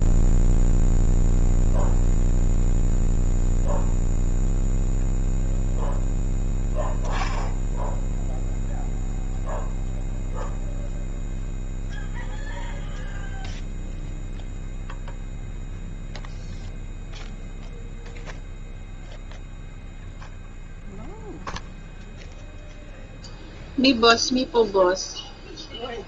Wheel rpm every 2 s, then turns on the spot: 0, 0, 0, 0, 0, 0, 0, 0, 0, 0, 0, 0, 0.
none